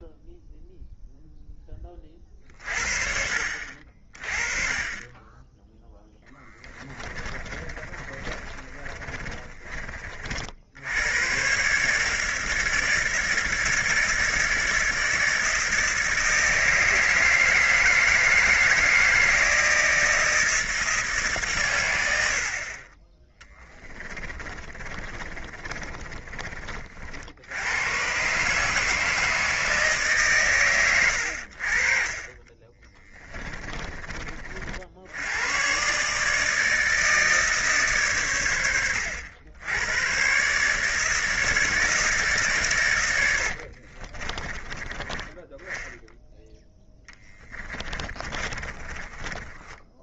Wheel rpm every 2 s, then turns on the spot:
0, 50, 30, 30, 40, 70, 160, 160, 160, 160, 160, 70, 30, 30, 140, 120, 30, 40, 150, 100, 140, 140, 30, 10, 20.
6-10 24-26 32-34 44-46 48-50